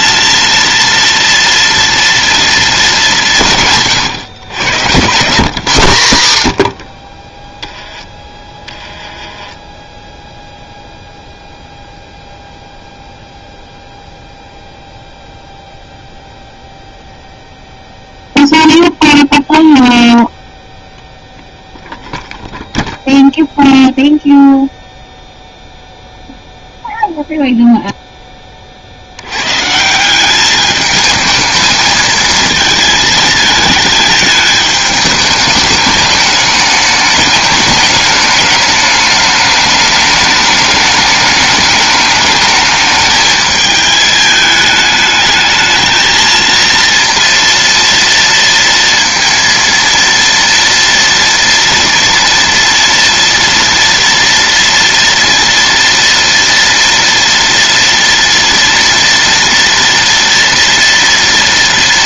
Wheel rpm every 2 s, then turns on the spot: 230, 220, 110, 90, 10, 0, 0, 0, 0, 0, 0, 0, 0, 0, 30, 210, 220, 220, 210, 210, 210, 210, 210, 230, 230, 230, 230, 230, 230, 230, 230.
none